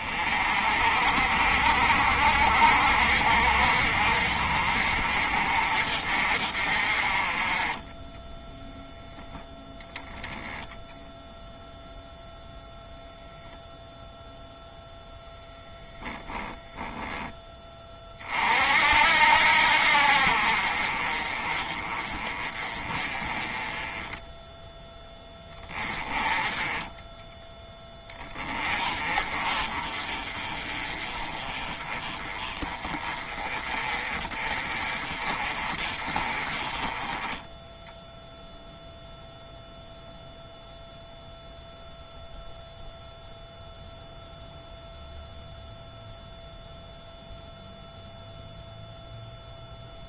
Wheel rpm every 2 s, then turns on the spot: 50, 60, 50, 40, 0, 0, 0, 0, 10, 60, 40, 30, 10, 10, 40, 30, 30, 30, 20, 0, 0, 0, 0, 0, 0.
16-18 26-28